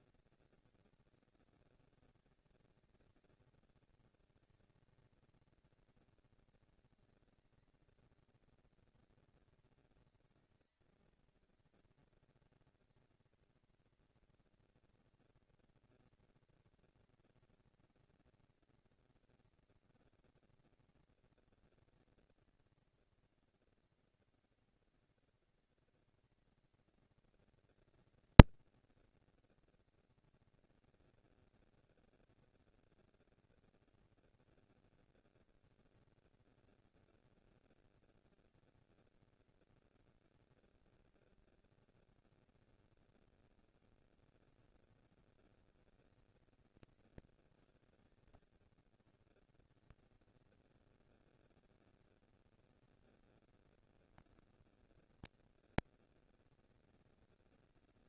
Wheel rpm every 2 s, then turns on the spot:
180, 170, 210, 230, 230, 230, 230, 240, 230, 230, 230, 240, 230, 230, 230, 230, 240, 230, 230, 230, 220, 230, 210, 170, 120, 200, 230, 230, 230.
none